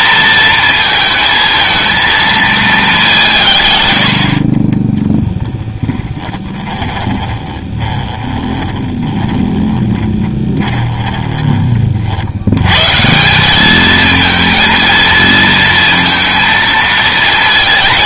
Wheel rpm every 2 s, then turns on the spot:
230, 210, 20, 20, 20, 20, 120, 230, 230.
4-12